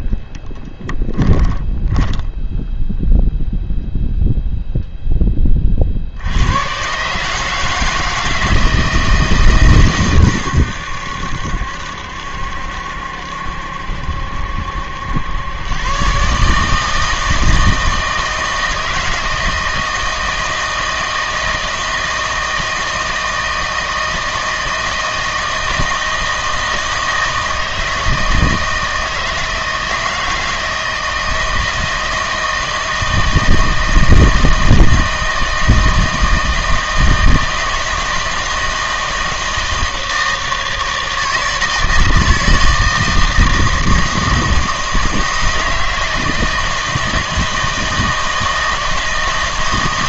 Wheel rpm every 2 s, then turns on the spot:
20, 0, 0, 110, 160, 100, 70, 80, 150, 160, 160, 160, 160, 160, 160, 160, 160, 160, 160, 160, 160, 160, 160, 160, 160.
0-2